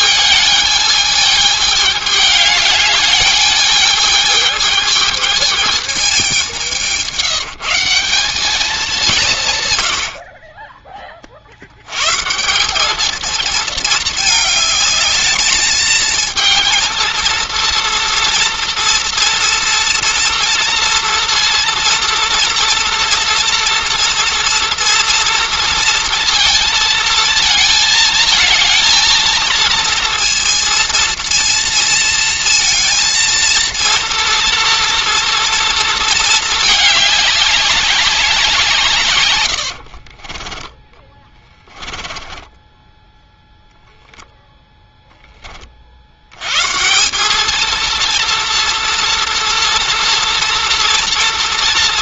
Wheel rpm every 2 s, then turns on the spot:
210, 210, 220, 180, 200, 20, 200, 210, 230, 230, 230, 240, 230, 220, 230, 230, 230, 240, 210, 160, 20, 10, 0, 160, 230, 230.
40-44